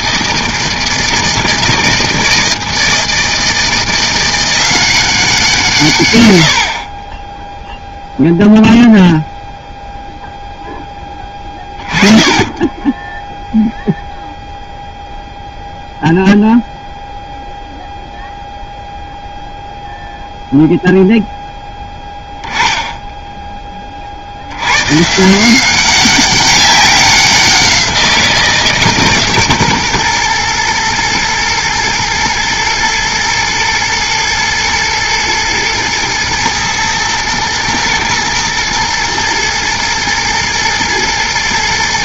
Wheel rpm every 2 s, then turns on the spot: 160, 160, 180, 80, 0, 0, 20, 0, 0, 0, 0, 10, 110, 190, 160, 120, 120, 110, 110, 110, 110.
12-14